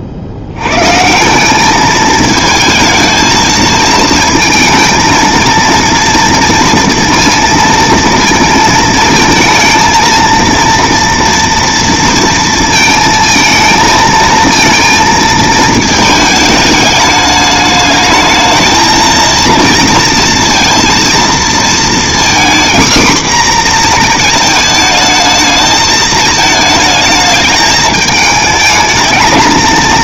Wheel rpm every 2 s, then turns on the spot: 90, 220, 230, 230, 220, 230, 230, 230, 210, 220, 230, 250, 220, 220, 210.
none